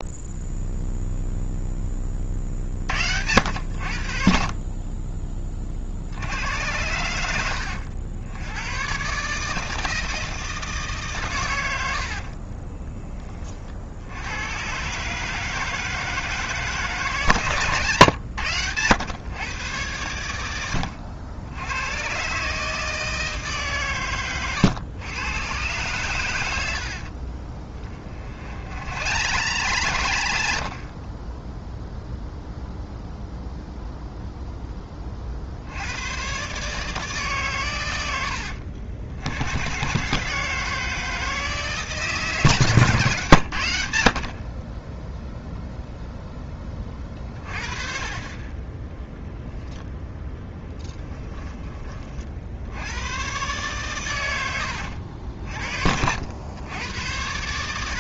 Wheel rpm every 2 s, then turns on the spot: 0, 70, 30, 90, 110, 150, 20, 130, 150, 100, 80, 150, 110, 70, 80, 40, 0, 10, 150, 70, 160, 140, 30, 20, 10, 10, 80, 80, 100.
12-14 20-22 26-32 50-52